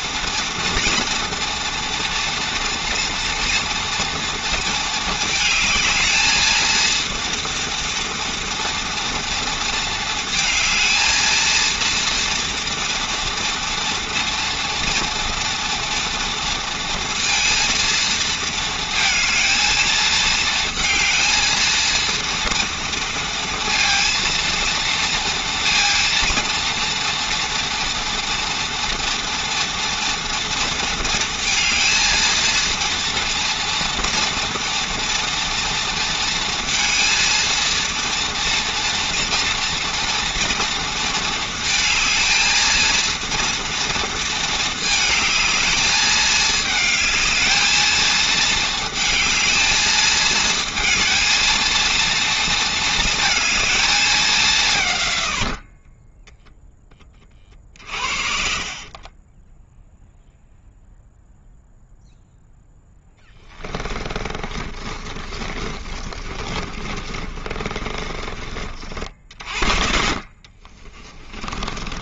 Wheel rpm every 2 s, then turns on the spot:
230, 230, 220, 220, 230, 220, 230, 230, 230, 230, 230, 230, 230, 230, 240, 230, 230, 230, 230, 230, 230, 230, 220, 220, 220, 230, 230, 150, 10, 40, 0, 10, 30, 30, 40, 30.
58-60 62-68 70-72